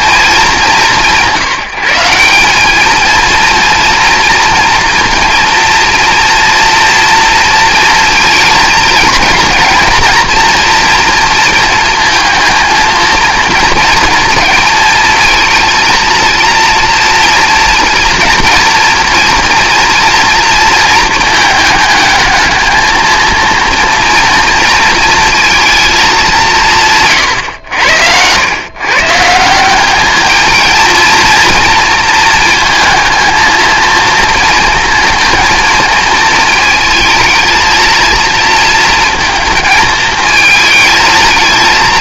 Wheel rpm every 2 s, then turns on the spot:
190, 210, 240, 230, 220, 230, 230, 220, 230, 230, 230, 220, 230, 170, 130, 230, 230, 220, 220, 230, 220.
none